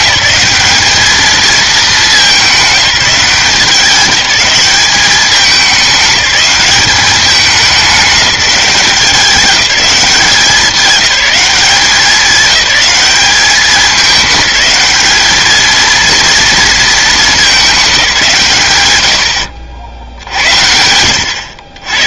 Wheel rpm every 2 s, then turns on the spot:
210, 190, 200, 200, 190, 180, 200, 210, 230, 140, 70.
none